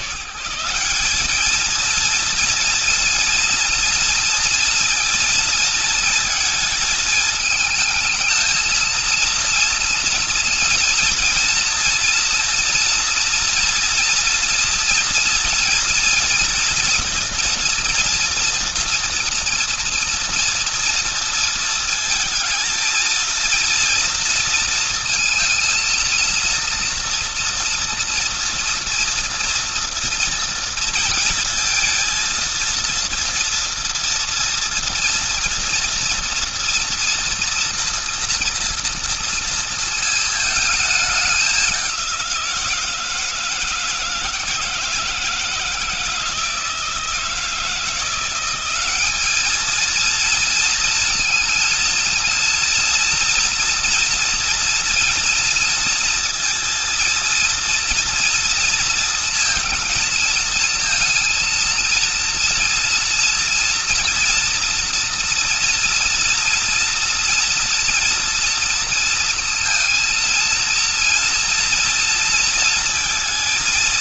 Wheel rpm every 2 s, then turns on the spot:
140, 230, 230, 230, 220, 230, 230, 230, 240, 240, 230, 220, 230, 230, 230, 230, 230, 230, 230, 240, 220, 180, 160, 160, 180, 230, 230, 230, 230, 230, 230, 230, 230, 230, 230, 230, 230.
none